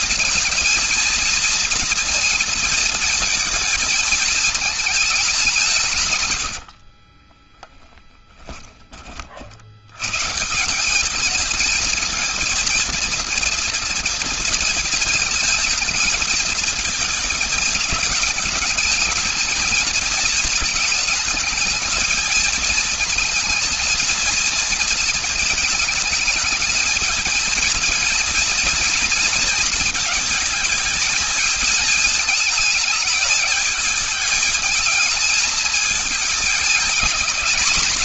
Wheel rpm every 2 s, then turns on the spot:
230, 230, 220, 90, 10, 150, 230, 230, 220, 220, 220, 220, 230, 220, 230, 230, 220, 220, 220.
6-8